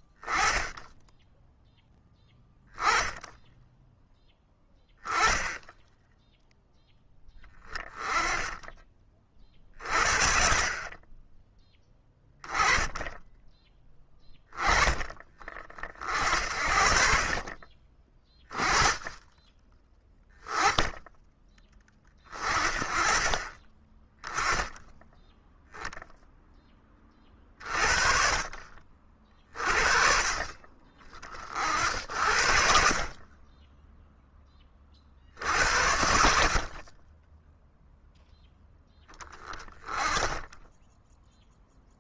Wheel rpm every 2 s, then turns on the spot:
10, 10, 10, 10, 30, 30, 10, 20, 50, 20, 10, 30, 10, 20, 40, 50, 40, 40, 40, 10, 10.
none